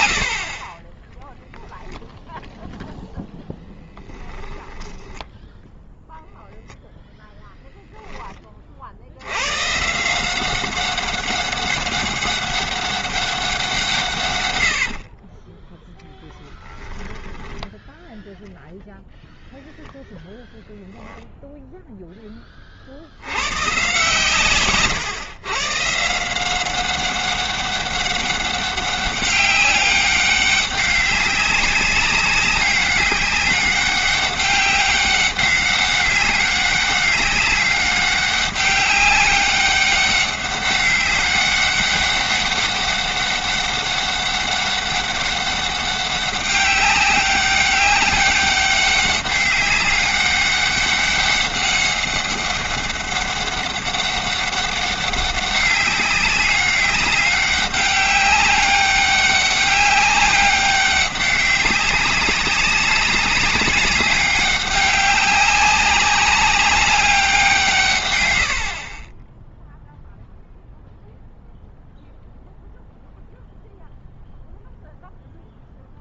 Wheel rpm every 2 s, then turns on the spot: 30, 0, 10, 0, 30, 190, 200, 80, 10, 0, 10, 40, 130, 180, 200, 200, 200, 200, 190, 200, 200, 200, 200, 200, 200, 200, 200, 200, 200, 190, 200, 200, 200, 200, 60, 0, 0, 0.
4-6 14-18